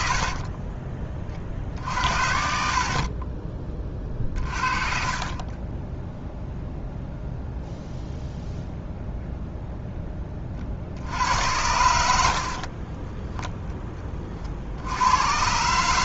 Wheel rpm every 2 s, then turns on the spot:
30, 60, 40, 0, 0, 40, 40, 60.
0-4 12-14